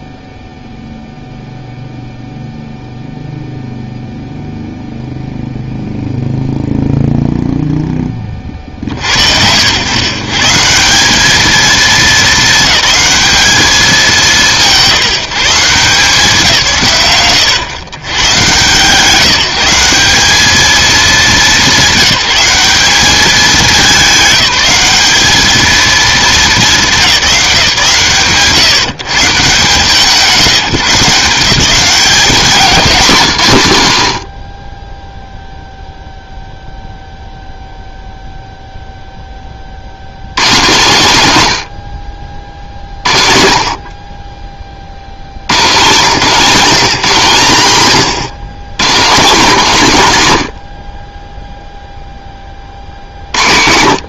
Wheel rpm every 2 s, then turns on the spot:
0, 0, 0, 0, 60, 180, 220, 190, 150, 150, 220, 200, 200, 220, 150, 170, 200, 10, 0, 0, 170, 70, 40, 190, 190, 40, 50.
none